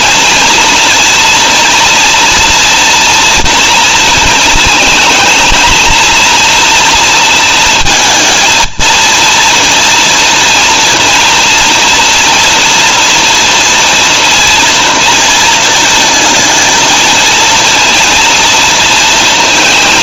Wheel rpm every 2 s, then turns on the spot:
240, 230, 230, 230, 230, 230, 240, 230, 230, 230.
none